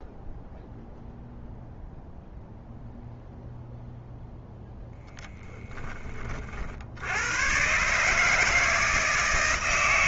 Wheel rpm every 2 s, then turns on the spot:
0, 0, 0, 90, 160.
none